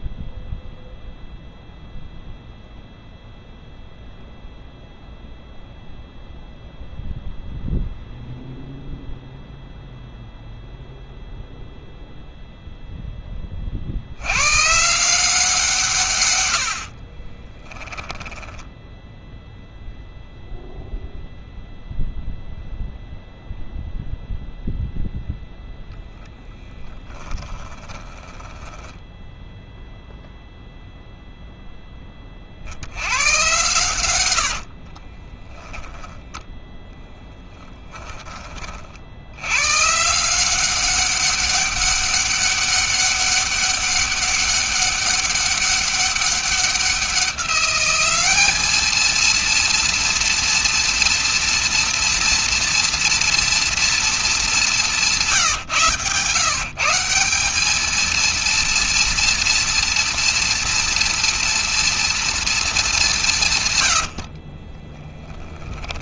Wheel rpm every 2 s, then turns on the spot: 0, 0, 0, 0, 0, 0, 0, 130, 90, 10, 0, 0, 0, 10, 10, 0, 70, 50, 10, 40, 180, 200, 200, 190, 220, 240, 230, 200, 160, 230, 230, 210, 30.
16-20 26-30 34-36 64-66